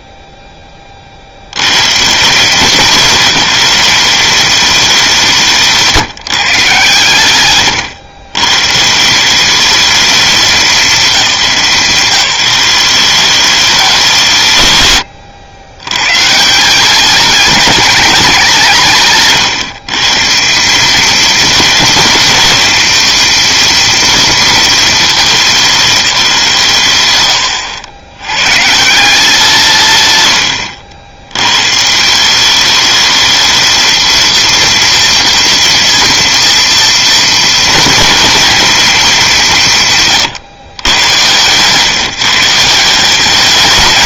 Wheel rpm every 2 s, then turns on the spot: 20, 190, 190, 140, 140, 180, 180, 130, 180, 140, 200, 230, 210, 120, 170, 80, 200, 230, 230, 220, 120, 180.
30-32